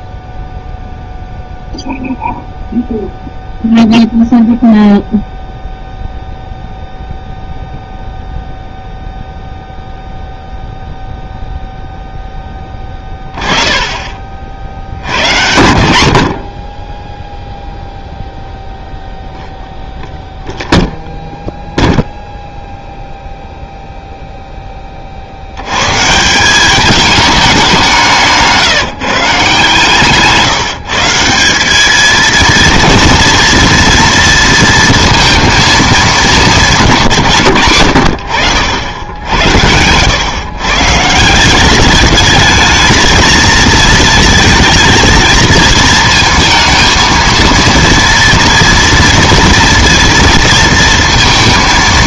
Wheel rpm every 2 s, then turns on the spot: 0, 0, 0, 0, 0, 0, 20, 70, 20, 0, 0, 0, 20, 200, 160, 160, 230, 230, 170, 80, 140, 220, 230, 230, 230, 230.
none